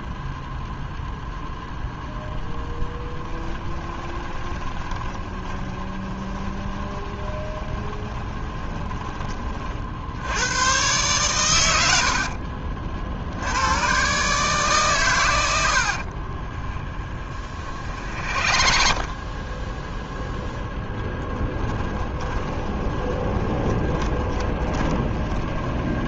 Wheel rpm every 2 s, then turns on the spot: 0, 10, 20, 20, 20, 120, 50, 130, 20, 40, 10, 20, 20.
2-8 16-26